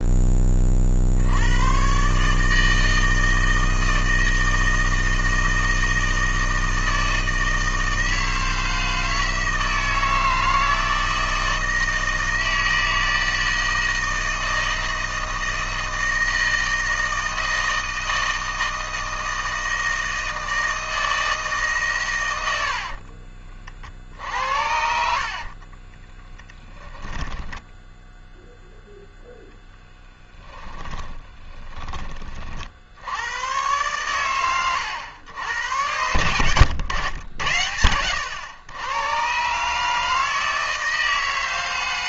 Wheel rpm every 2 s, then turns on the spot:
40, 160, 160, 160, 160, 160, 160, 160, 160, 160, 160, 70, 70, 10, 0, 20, 60, 100, 100, 110, 160.
22-28 30-32 36-38